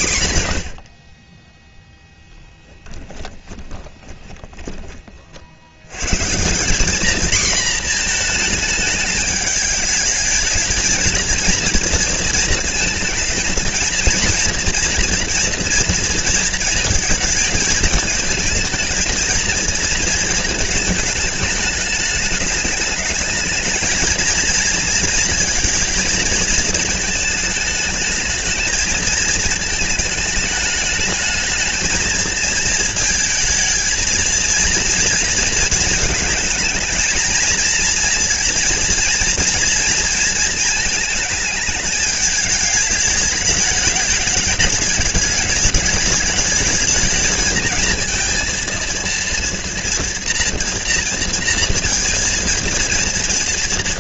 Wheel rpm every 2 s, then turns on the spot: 50, 20, 50, 220, 210, 230, 220, 230, 220, 230, 210, 220, 230, 220, 220, 220, 220, 230, 220, 230, 220, 210, 200, 220, 230, 230, 230.
2-4